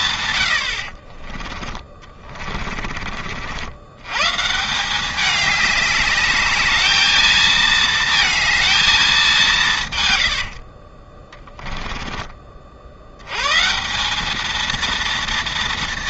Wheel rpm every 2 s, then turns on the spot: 90, 30, 170, 210, 220, 60, 50, 230.
2-4 10-12